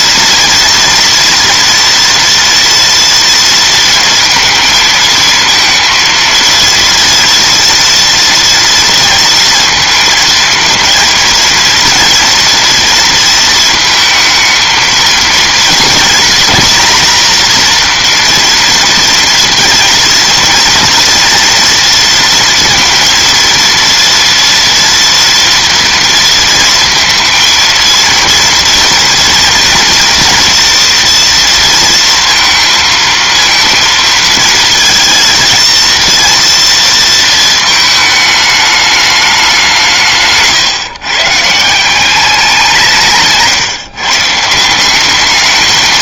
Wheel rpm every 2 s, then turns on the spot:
240, 230, 230, 230, 230, 230, 230, 230, 240, 230, 230, 230, 230, 230, 230, 240, 230, 230, 230, 210, 140, 180, 180.
none